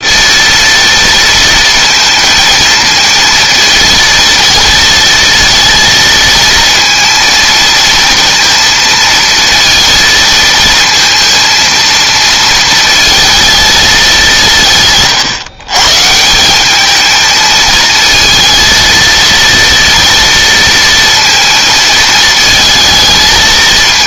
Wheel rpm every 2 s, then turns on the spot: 230, 230, 230, 230, 230, 230, 230, 150, 210, 230, 230, 220.
none